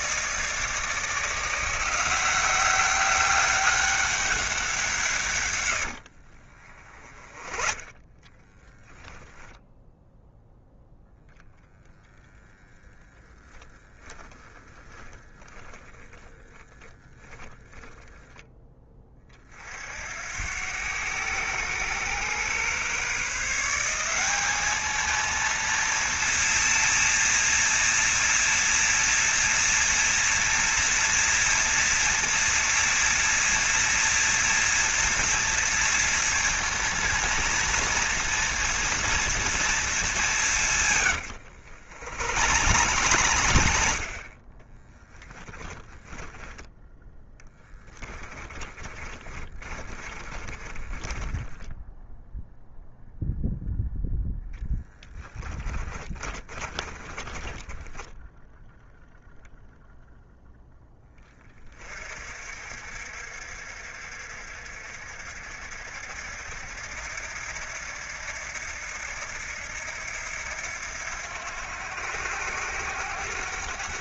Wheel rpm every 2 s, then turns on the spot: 160, 190, 160, 20, 0, 0, 10, 10, 10, 20, 100, 130, 220, 230, 230, 230, 230, 240, 230, 230, 110, 100, 20, 10, 20, 10, 0, 20, 20, 0, 10, 50, 60, 70, 80, 80, 90.
6-8 14-18 40-46 48-52 54-58